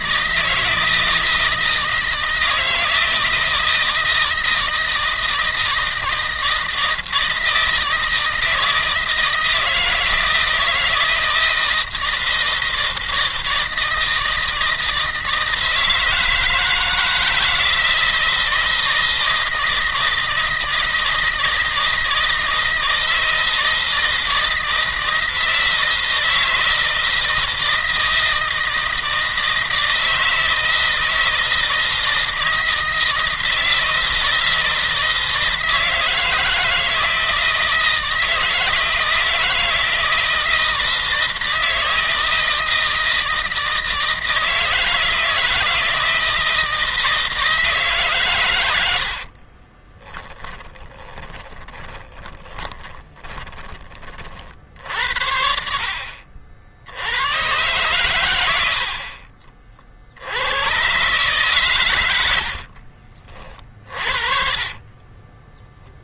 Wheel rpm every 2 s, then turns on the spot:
160, 160, 160, 160, 160, 160, 160, 160, 160, 160, 160, 160, 160, 160, 160, 160, 160, 160, 160, 160, 160, 160, 160, 160, 90, 20, 20, 60, 80, 60, 130, 50, 30.
48-54 62-66